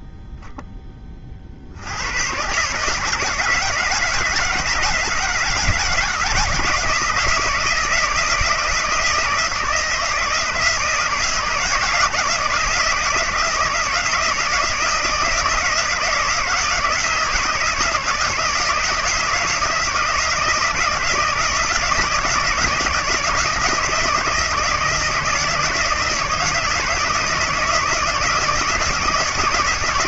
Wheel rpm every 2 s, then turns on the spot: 0, 130, 160, 160, 160, 160, 160, 170, 160, 160, 160, 160, 160, 160, 170.
none